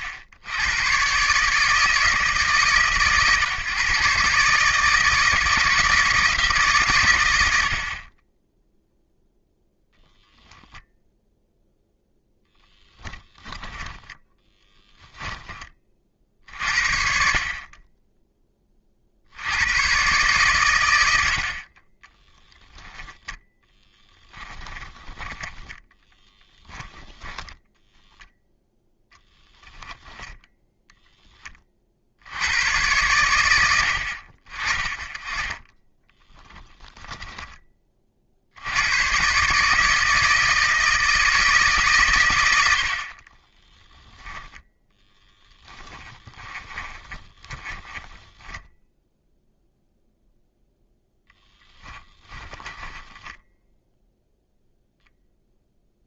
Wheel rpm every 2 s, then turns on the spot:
100, 140, 150, 140, 0, 0, 10, 10, 40, 30, 110, 0, 10, 10, 0, 0, 100, 30, 10, 90, 160, 70, 10, 20, 10, 0, 10, 0.
12-16 24-28 36-38 46-48 52-54